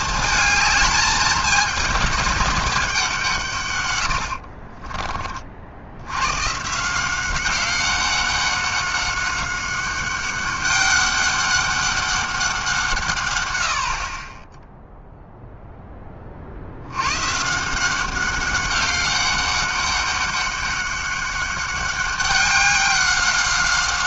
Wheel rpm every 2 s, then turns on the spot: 220, 200, 50, 140, 190, 200, 180, 10, 60, 200, 200, 200.
4-6